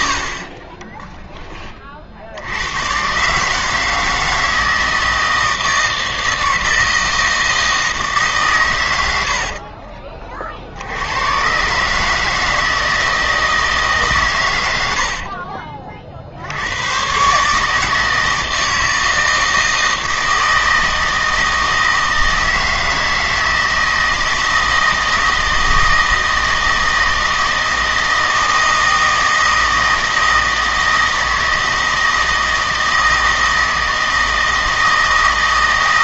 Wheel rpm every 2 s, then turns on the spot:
20, 100, 160, 160, 110, 70, 160, 100, 90, 160, 160, 160, 160, 160, 160, 160, 160, 160.
0-2